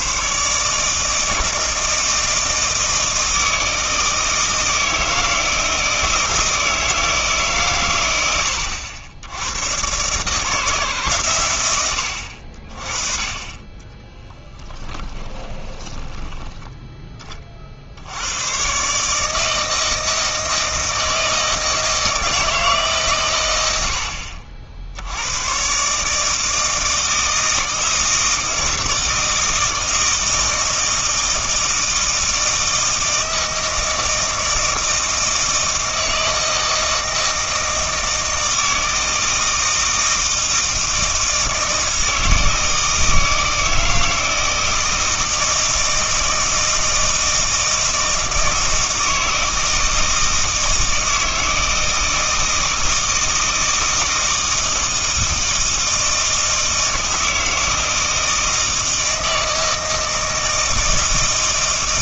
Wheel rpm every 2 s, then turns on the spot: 140, 160, 160, 160, 90, 150, 40, 10, 10, 120, 160, 160, 60, 160, 160, 160, 160, 160, 160, 160, 160, 160, 160, 160, 160, 160, 160, 160, 160, 160, 160.
14-16